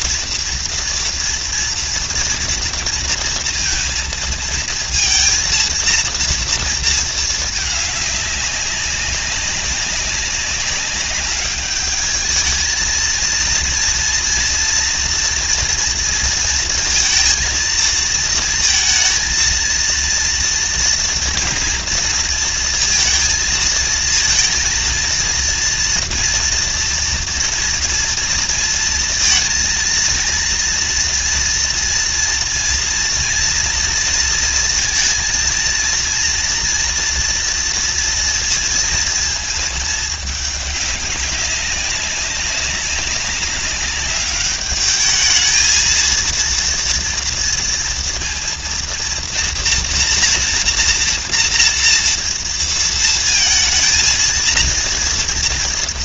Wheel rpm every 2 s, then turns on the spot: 230, 230, 230, 230, 200, 200, 220, 230, 220, 230, 230, 230, 230, 230, 230, 230, 240, 230, 230, 230, 200, 200, 210, 230, 230, 230, 230, 230.
none